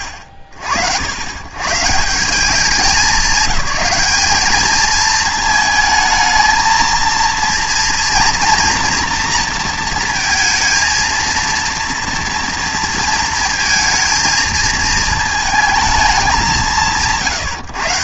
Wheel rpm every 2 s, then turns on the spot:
70, 190, 220, 230, 230, 230, 230, 220, 150.
none